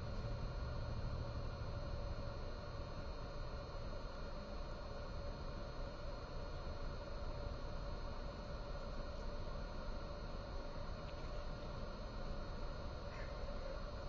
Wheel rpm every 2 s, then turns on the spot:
0, 0, 0, 0, 0, 0, 0.
none